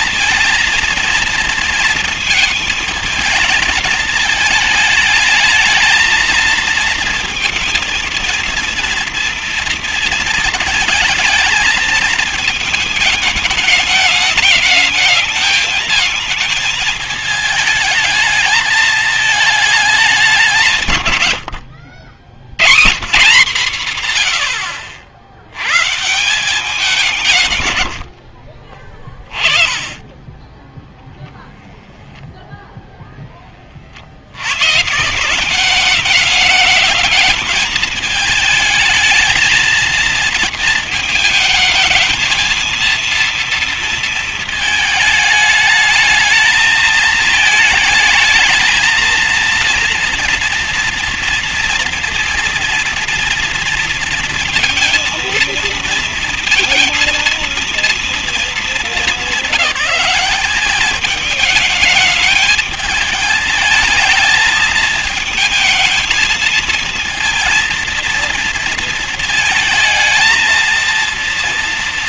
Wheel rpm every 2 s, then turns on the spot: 230, 220, 210, 230, 230, 220, 220, 220, 220, 220, 180, 110, 70, 180, 40, 10, 0, 120, 210, 220, 220, 230, 220, 220, 230, 230, 230, 230, 230, 210, 200, 210, 220, 230, 230, 230.
none